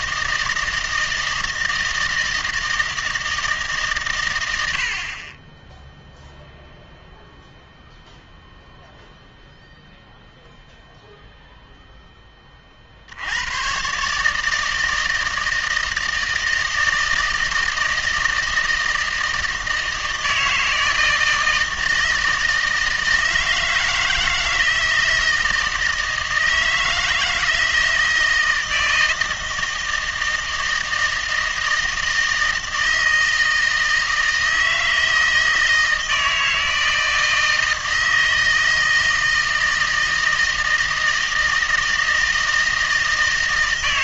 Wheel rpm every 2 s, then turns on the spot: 160, 160, 80, 0, 0, 0, 30, 160, 160, 160, 160, 160, 160, 160, 160, 160, 160, 160, 160, 160, 160, 160.
none